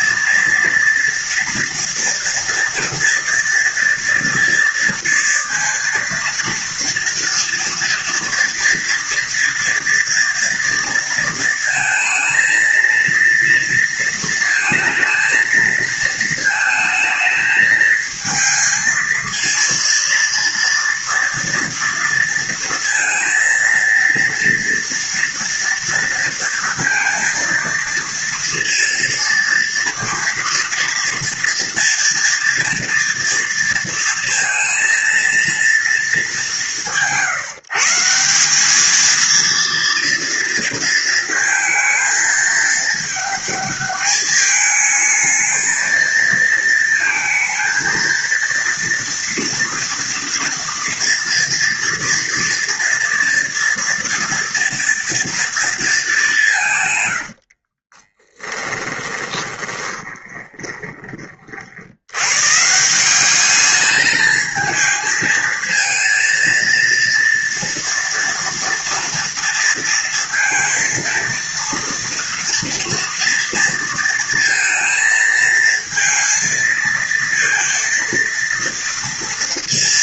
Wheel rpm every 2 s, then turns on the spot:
230, 230, 230, 230, 230, 230, 230, 230, 220, 230, 230, 230, 230, 230, 230, 230, 230, 230, 150, 220, 230, 210, 220, 230, 230, 230, 230, 230, 110, 20, 30, 180, 220, 230, 230, 230, 230, 230, 230, 230.
56-60